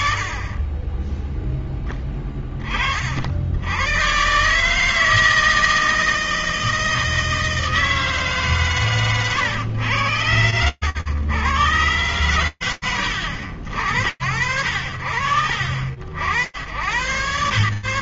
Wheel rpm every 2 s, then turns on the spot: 10, 90, 160, 160, 110, 130, 70, 50, 100.
none